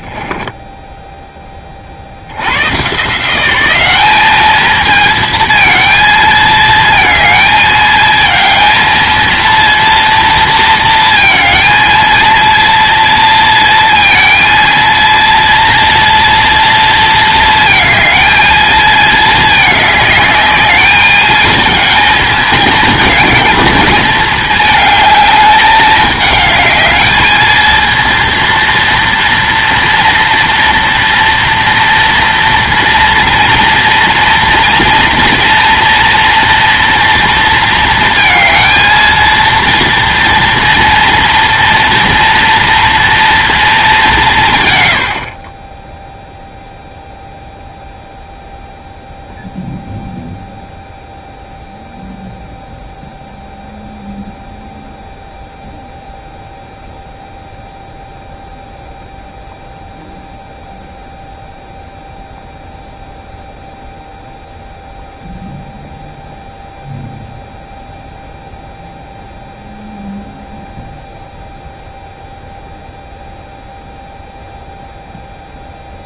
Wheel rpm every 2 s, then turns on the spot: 10, 110, 220, 220, 220, 230, 230, 230, 230, 220, 210, 220, 210, 210, 230, 230, 230, 230, 230, 230, 230, 230, 140, 0, 0, 0, 0, 0, 0, 0, 0, 0, 0, 0, 0, 0, 0, 0.
0-2